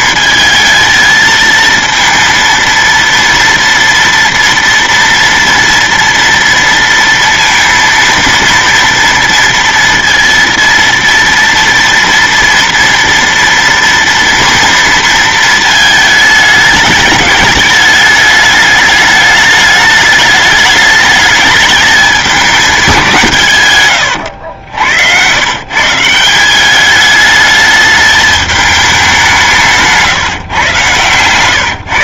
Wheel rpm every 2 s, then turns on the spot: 220, 230, 230, 230, 230, 230, 230, 230, 210, 210, 210, 180, 90, 210, 200, 140.
30-32